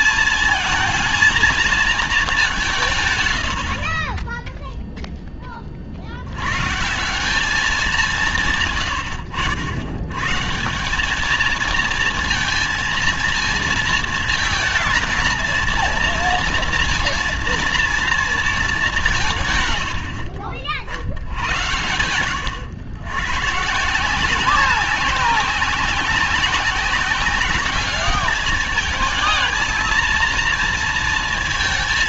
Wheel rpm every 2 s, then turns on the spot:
220, 170, 0, 120, 130, 160, 230, 230, 230, 210, 70, 90, 190, 190, 210, 230.
none